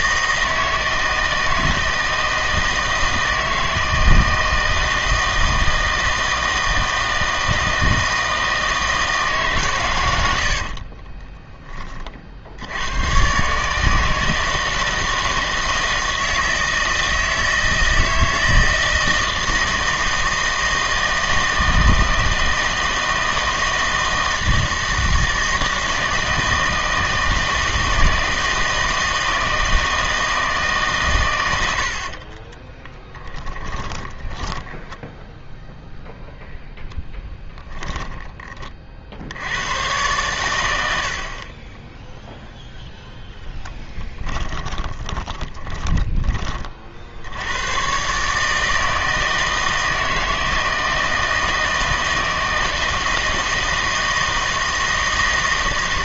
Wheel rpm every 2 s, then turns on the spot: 160, 160, 160, 160, 160, 50, 70, 160, 160, 160, 160, 160, 160, 160, 160, 150, 20, 10, 0, 30, 100, 0, 10, 30, 150, 160, 160, 160.
10-12 32-36 44-46